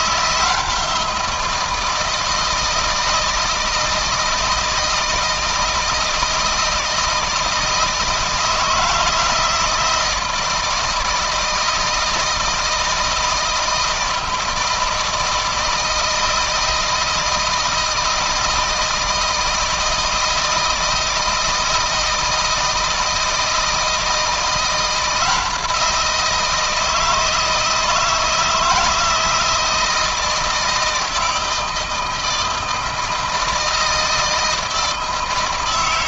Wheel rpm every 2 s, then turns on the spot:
170, 160, 160, 160, 170, 160, 160, 160, 160, 160, 160, 160, 170, 160, 160, 160, 160, 160.
none